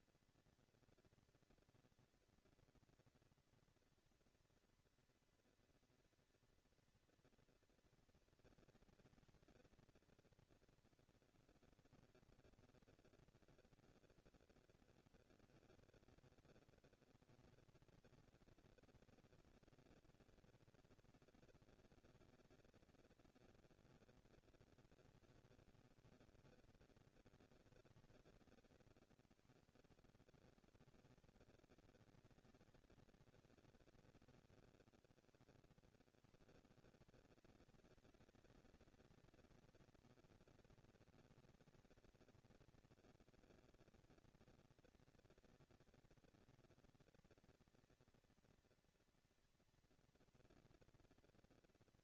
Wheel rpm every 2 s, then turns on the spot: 240, 230, 230, 230, 230, 230, 230, 230, 230, 220, 230, 230, 210, 200, 150, 120, 220, 90, 150, 220, 230, 180, 220, 230, 230, 230.
none